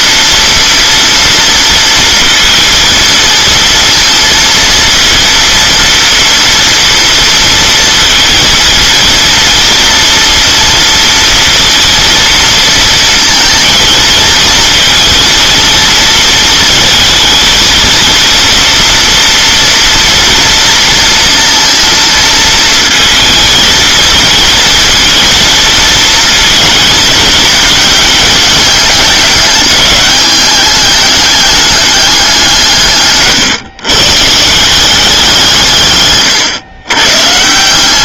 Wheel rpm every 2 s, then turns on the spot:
240, 230, 230, 230, 230, 230, 230, 230, 230, 240, 230, 230, 230, 230, 210, 210, 150, 180, 120.
none